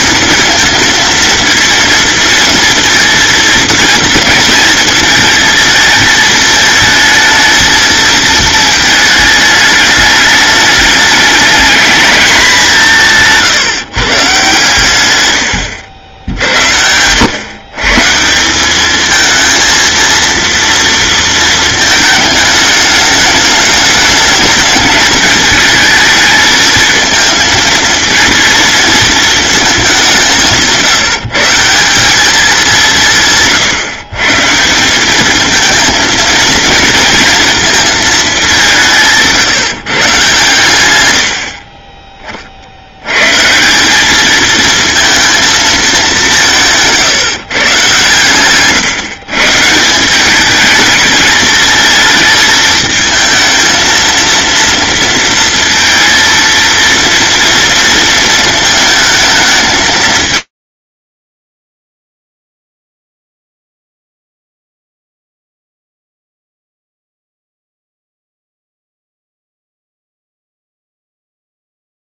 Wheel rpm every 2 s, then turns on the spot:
230, 220, 220, 220, 220, 210, 160, 120, 90, 220, 230, 210, 210, 220, 220, 170, 170, 190, 230, 170, 100, 60, 230, 160, 130, 210, 220, 230, 230, 220, 30, 0, 0, 0, 0, 0.
46-48